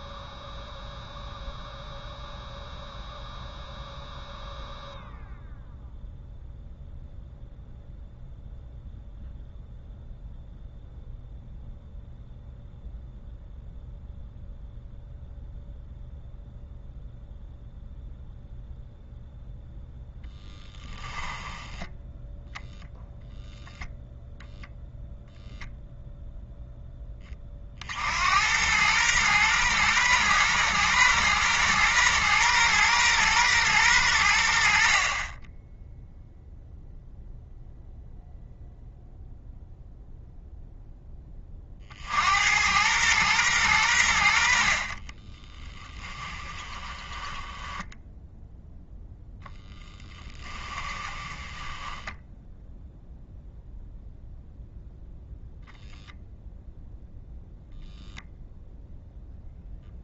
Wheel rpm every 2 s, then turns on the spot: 0, 0, 0, 0, 0, 0, 0, 0, 0, 0, 10, 0, 0, 10, 110, 120, 120, 40, 0, 0, 10, 110, 30, 10, 10, 20, 0, 0, 0, 0.
20-22 44-48 50-52